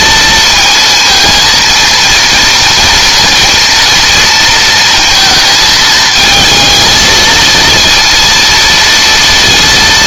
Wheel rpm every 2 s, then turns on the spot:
230, 230, 230, 220, 230.
none